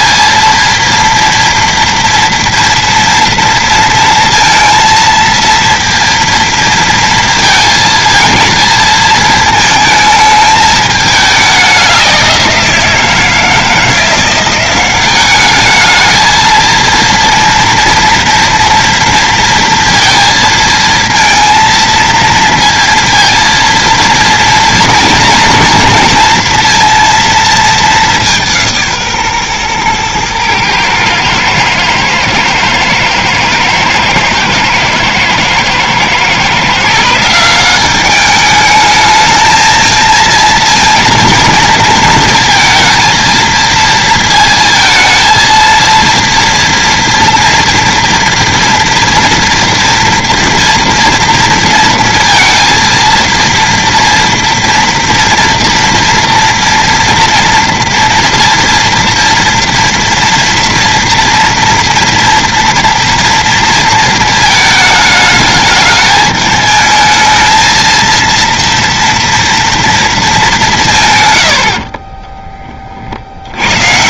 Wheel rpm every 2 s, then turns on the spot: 230, 240, 230, 230, 220, 210, 170, 190, 230, 230, 230, 230, 230, 230, 160, 110, 110, 120, 150, 210, 230, 230, 230, 230, 230, 230, 230, 230, 230, 230, 230, 230, 220, 220, 230, 170, 30.
none